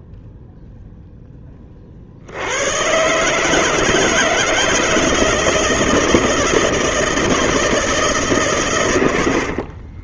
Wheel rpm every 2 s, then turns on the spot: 0, 110, 160, 160, 120.
none